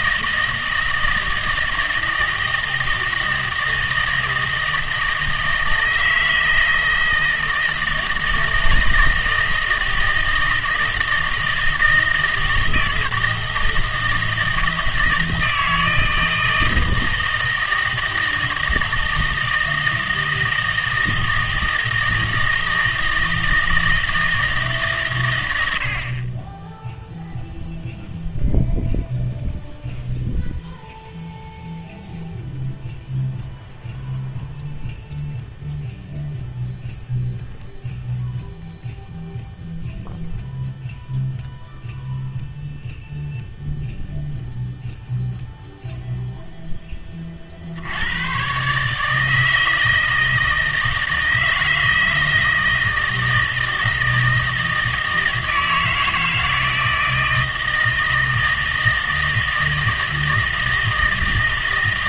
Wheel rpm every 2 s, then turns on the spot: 160, 160, 160, 160, 160, 160, 160, 160, 160, 160, 160, 160, 150, 10, 0, 0, 0, 0, 0, 0, 0, 0, 0, 10, 140, 160, 160, 160, 160, 160, 160.
none